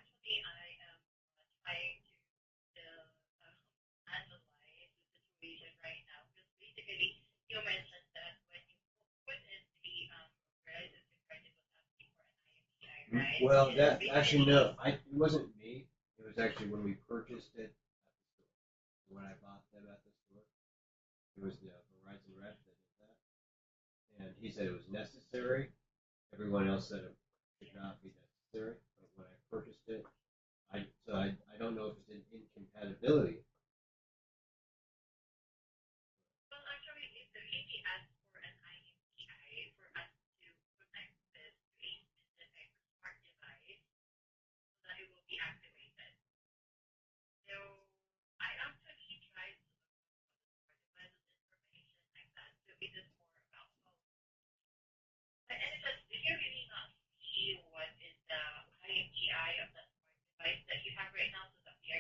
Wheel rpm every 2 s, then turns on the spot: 0, 0, 0, 0, 0, 0, 0, 0, 0, 0, 0, 0, 0, 0, 0, 0, 0, 0, 0, 0, 0, 0, 0, 0, 0, 0, 0, 0, 0, 0, 0.
none